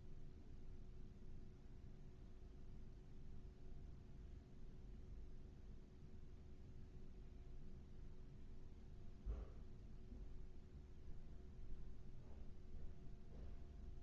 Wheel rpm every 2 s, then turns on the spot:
0, 0, 0, 0, 0, 0, 0.
none